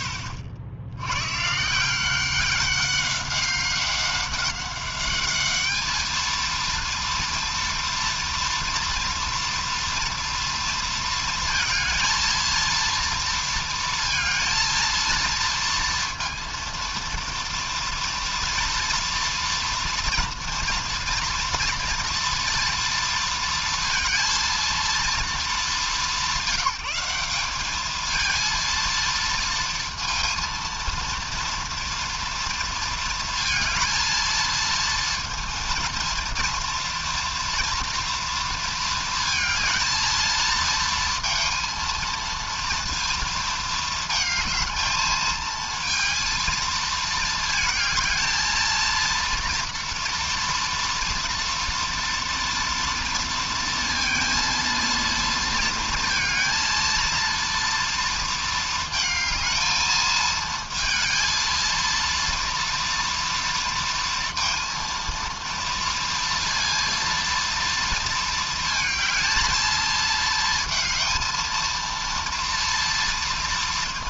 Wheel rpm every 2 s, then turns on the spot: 80, 200, 200, 230, 230, 230, 230, 230, 230, 230, 230, 230, 230, 170, 230, 230, 230, 220, 230, 230, 230, 230, 220, 220, 220, 230, 230, 230, 230, 220, 220, 230, 230, 230, 220, 230, 230.
none